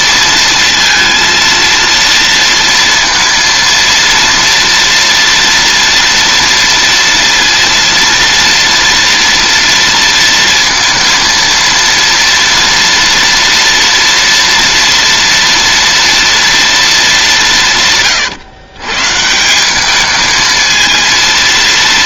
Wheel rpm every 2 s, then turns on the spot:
230, 230, 230, 230, 230, 230, 230, 230, 200, 150, 230.
none